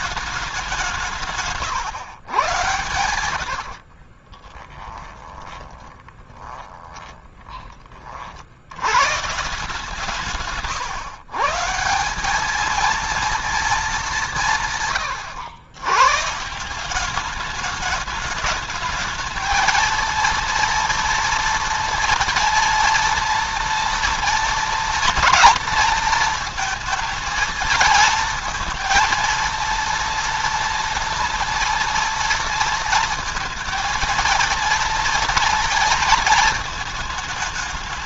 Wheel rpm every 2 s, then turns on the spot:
190, 110, 20, 20, 80, 130, 220, 160, 170, 210, 230, 230, 230, 230, 230, 230, 230, 230, 220.
4-8 10-12